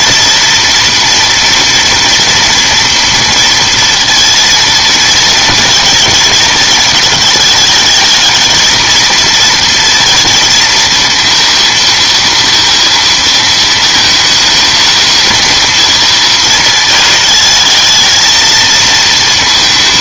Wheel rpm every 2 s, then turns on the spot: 230, 230, 230, 220, 220, 230, 230, 220, 220, 220.
none